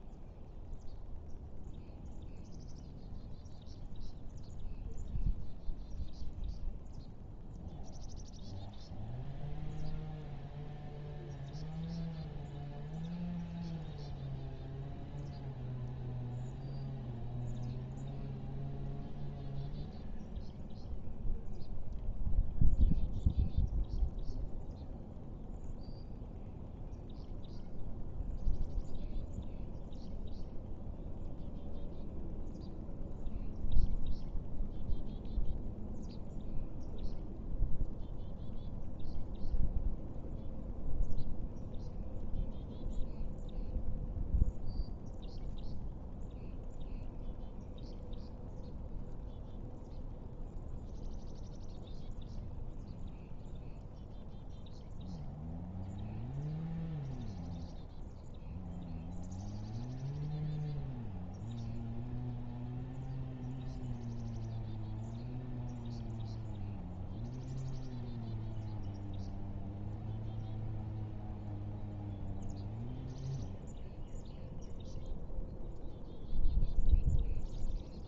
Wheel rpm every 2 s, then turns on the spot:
0, 0, 0, 0, 0, 0, 0, 0, 0, 0, 0, 0, 0, 0, 0, 0, 0, 0, 0, 0, 0, 0, 0, 0, 0, 0, 0, 0, 0, 0, 0, 0, 0, 0, 0, 0, 0, 0, 0.
none